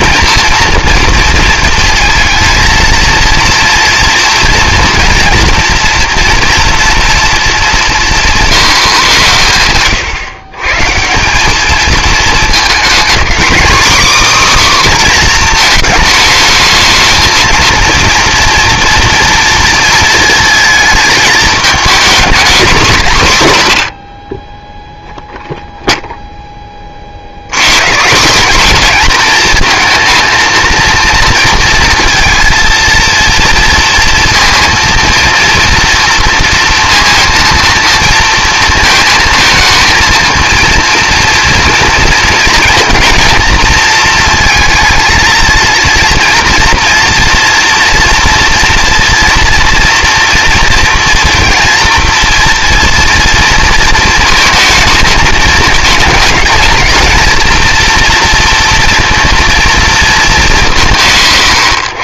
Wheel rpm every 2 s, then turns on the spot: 230, 230, 230, 230, 130, 180, 240, 250, 220, 240, 220, 160, 0, 50, 230, 230, 230, 230, 230, 230, 230, 230, 230, 230, 230, 230, 230, 220, 230, 230, 130.
none